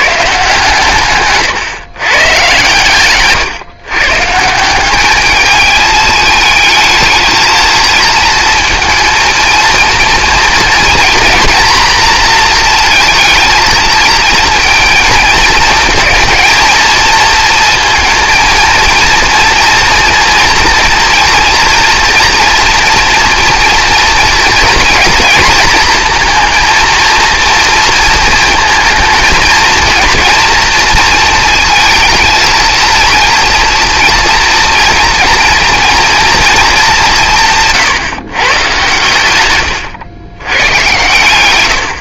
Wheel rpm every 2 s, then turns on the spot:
140, 130, 160, 220, 230, 230, 230, 230, 230, 220, 230, 230, 230, 230, 220, 230, 230, 230, 230, 130, 110.
none